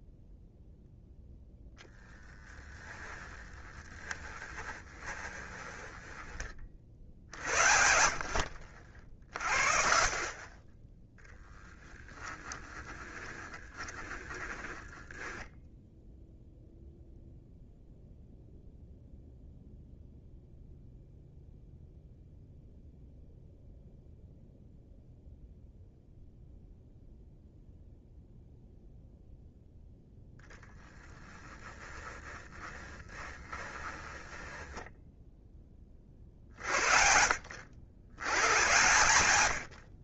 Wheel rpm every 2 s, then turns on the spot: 0, 20, 20, 40, 50, 10, 20, 20, 0, 0, 0, 0, 0, 0, 0, 10, 20, 10, 70, 100.
2-6 12-16 32-36